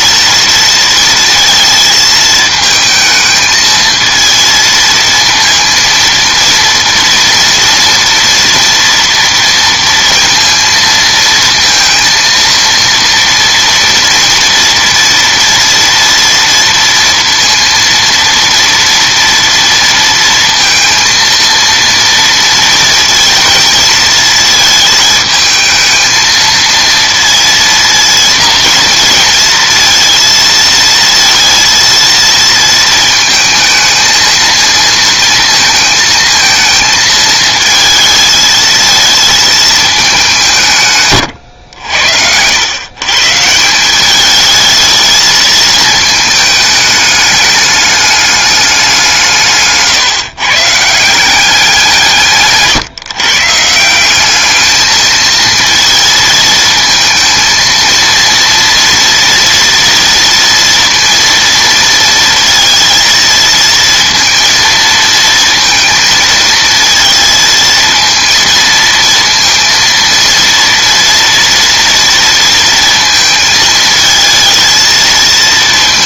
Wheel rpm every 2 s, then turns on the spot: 230, 220, 230, 230, 230, 230, 230, 230, 230, 230, 230, 230, 220, 230, 230, 230, 220, 230, 220, 220, 160, 100, 220, 210, 200, 150, 140, 210, 230, 230, 230, 230, 230, 230, 230, 230, 230, 220.
52-54